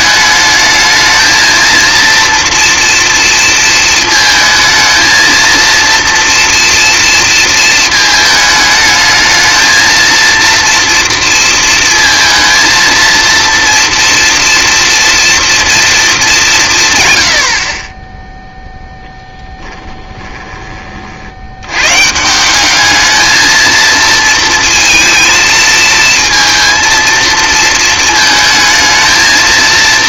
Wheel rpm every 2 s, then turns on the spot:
220, 240, 230, 230, 220, 230, 230, 230, 150, 0, 30, 190, 230, 230, 220.
none